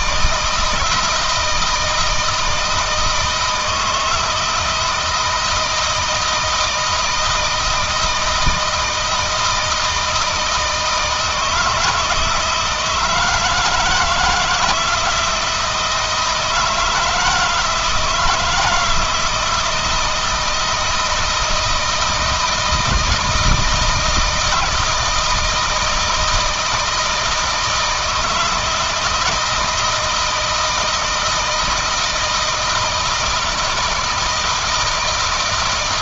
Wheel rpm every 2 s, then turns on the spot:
160, 160, 160, 160, 160, 160, 160, 160, 160, 160, 160, 160, 160, 160, 160, 160, 170, 160.
none